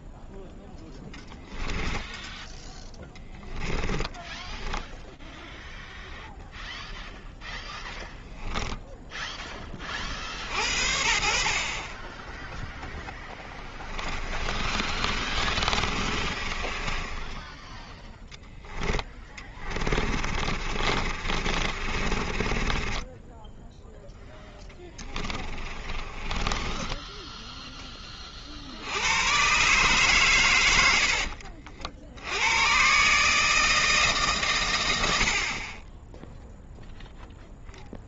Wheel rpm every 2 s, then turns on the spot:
10, 10, 10, 0, 10, 60, 20, 40, 20, 10, 50, 20, 20, 10, 90, 80, 140, 70, 0.
2-4 12-28